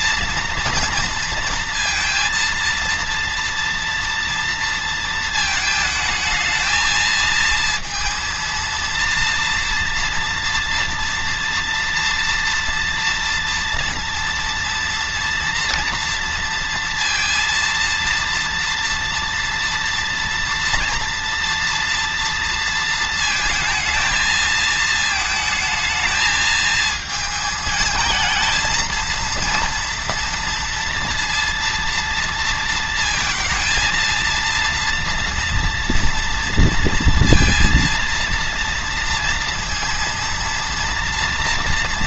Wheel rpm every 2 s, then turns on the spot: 230, 230, 230, 220, 230, 230, 230, 230, 230, 230, 230, 220, 220, 220, 230, 230, 230, 230, 230, 230, 230.
none